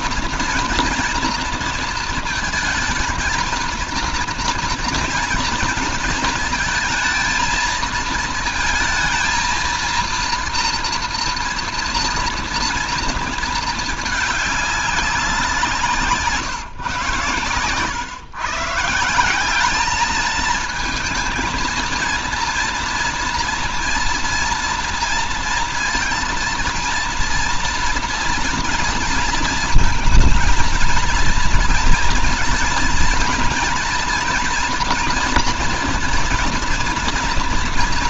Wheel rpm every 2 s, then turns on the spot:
240, 230, 230, 230, 230, 230, 230, 200, 140, 140, 220, 230, 230, 230, 230, 230, 230, 230, 230.
none